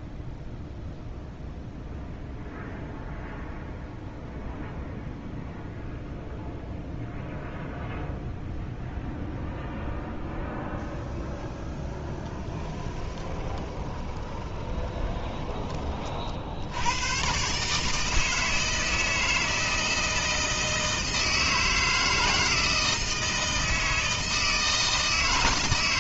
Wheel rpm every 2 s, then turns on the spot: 0, 0, 0, 0, 0, 0, 10, 20, 80, 160, 160, 160, 160.
12-16